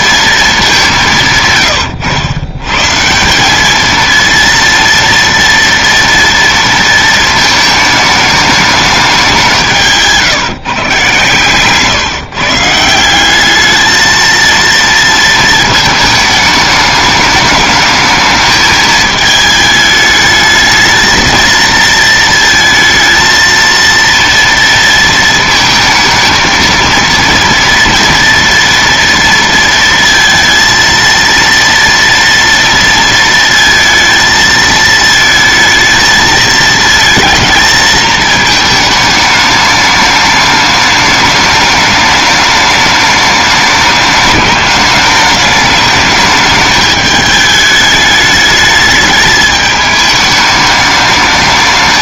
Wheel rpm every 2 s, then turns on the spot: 220, 110, 230, 230, 210, 150, 140, 220, 210, 220, 220, 230, 230, 220, 230, 230, 230, 220, 230, 220, 210, 210, 210, 210, 210, 210.
none